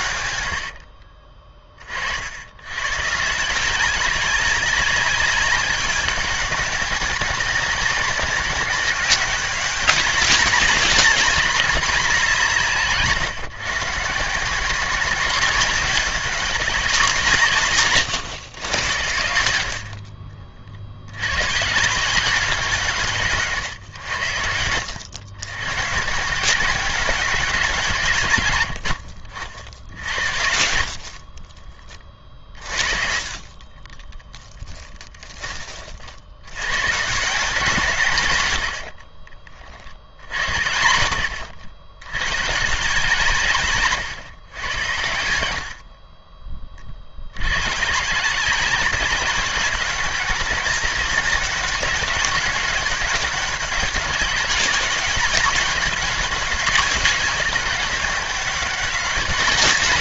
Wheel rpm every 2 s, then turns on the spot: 70, 100, 190, 200, 200, 200, 160, 170, 200, 110, 50, 160, 90, 180, 120, 60, 40, 10, 100, 100, 80, 140, 100, 30, 180, 190, 200, 190, 190, 190.
0-2 28-30 38-40